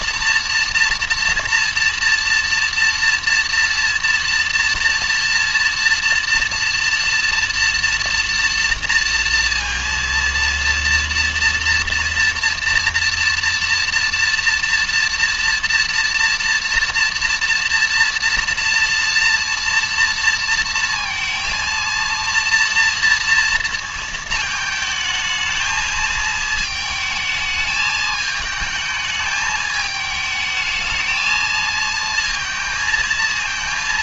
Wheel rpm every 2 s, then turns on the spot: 230, 230, 230, 230, 230, 230, 230, 230, 230, 230, 230, 230, 220, 220, 220, 220, 220.
none